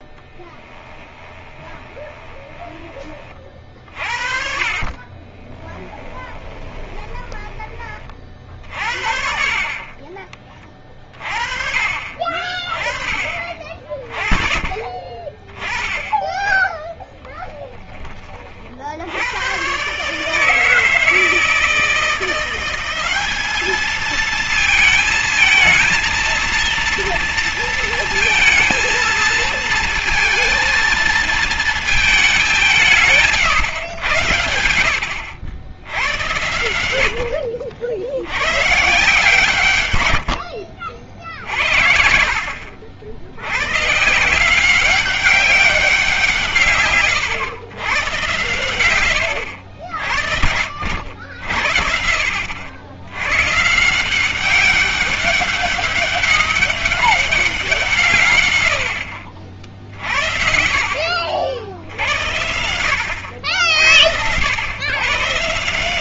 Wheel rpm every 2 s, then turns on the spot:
20, 20, 30, 20, 50, 30, 30, 20, 10, 50, 160, 180, 220, 230, 230, 220, 180, 80, 100, 120, 80, 60, 180, 150, 110, 60, 70, 190, 200, 100, 60, 80, 100.
0-2 6-8 16-18 40-42